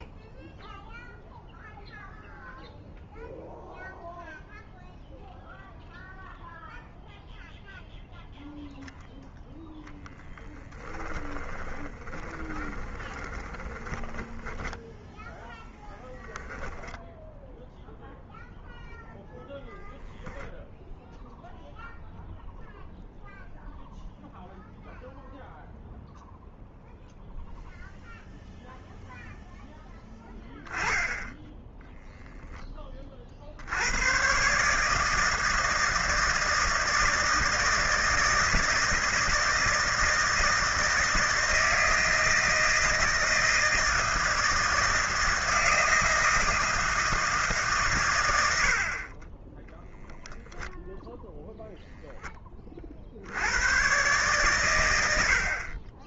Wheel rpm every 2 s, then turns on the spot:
0, 0, 0, 0, 0, 10, 20, 10, 10, 0, 0, 0, 0, 0, 0, 10, 10, 130, 160, 160, 160, 160, 160, 160, 90, 0, 20, 120.
10-18